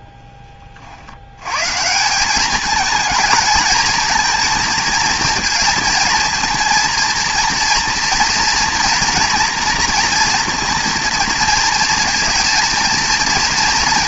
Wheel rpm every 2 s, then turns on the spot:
30, 210, 230, 230, 230, 230, 230.
none